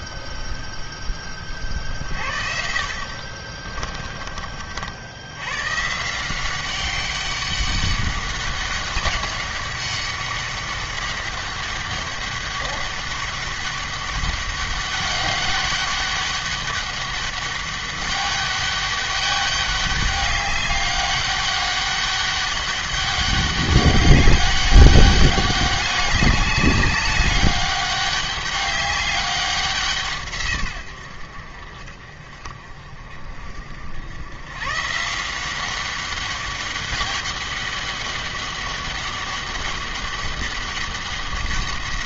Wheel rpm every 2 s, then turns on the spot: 0, 50, 60, 190, 200, 200, 200, 200, 200, 200, 200, 200, 200, 200, 200, 120, 50, 140, 200, 200, 200.
none